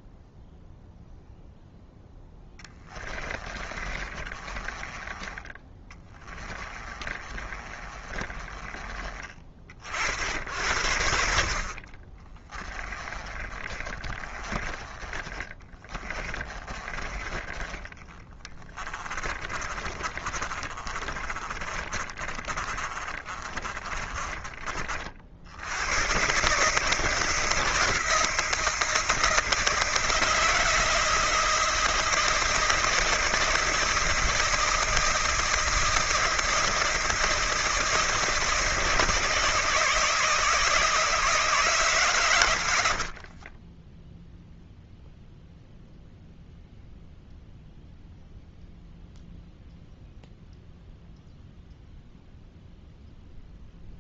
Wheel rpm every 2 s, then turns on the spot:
0, 20, 30, 20, 30, 80, 20, 20, 20, 20, 30, 30, 30, 140, 160, 160, 160, 160, 160, 160, 160, 100, 0, 0, 0, 0, 0.
2-8 12-24 42-44